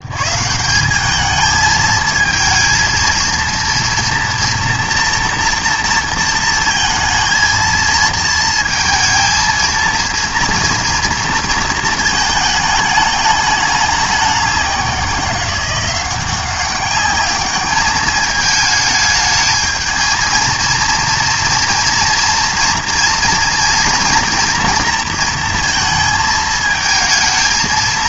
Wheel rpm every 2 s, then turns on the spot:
170, 220, 230, 230, 230, 230, 210, 190, 190, 220, 230, 230, 230, 220.
none